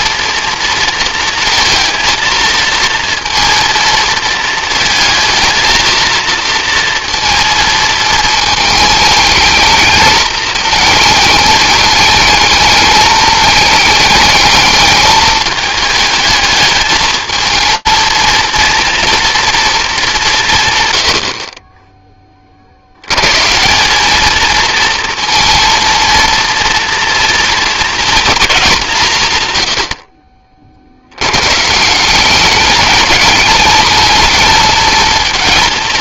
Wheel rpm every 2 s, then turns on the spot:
230, 230, 220, 230, 210, 220, 220, 220, 220, 230, 130, 40, 220, 230, 210, 60, 200, 220.
none